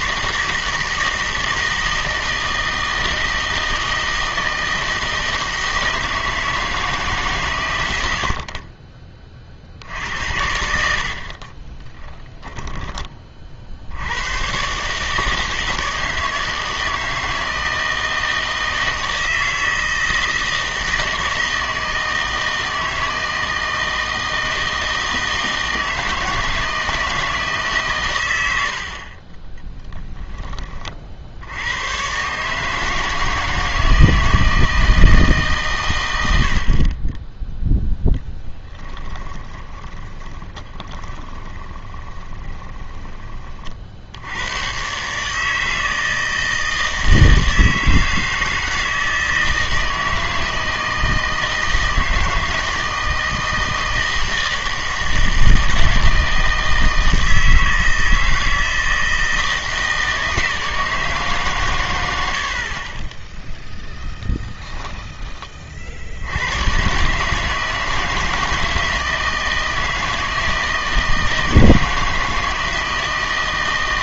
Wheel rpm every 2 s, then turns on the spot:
160, 160, 160, 160, 50, 80, 10, 120, 160, 160, 160, 160, 160, 160, 80, 20, 150, 160, 70, 10, 20, 20, 110, 160, 160, 160, 160, 160, 160, 160, 160, 60, 10, 110, 160, 160, 160.
12-14 38-44 64-66